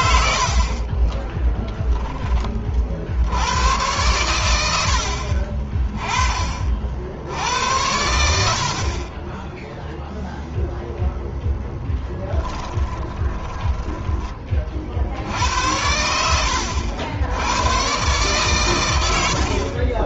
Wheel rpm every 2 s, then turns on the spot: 30, 50, 70, 70, 40, 0, 10, 50, 90, 100.
0-2 12-14